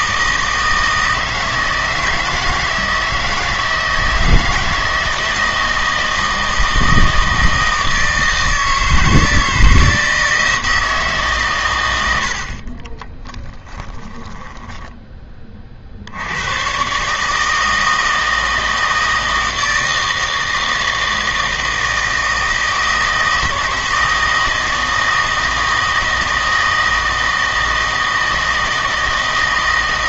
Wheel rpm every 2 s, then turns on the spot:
160, 160, 160, 160, 160, 160, 40, 10, 120, 160, 160, 160, 160, 160, 160.
12-16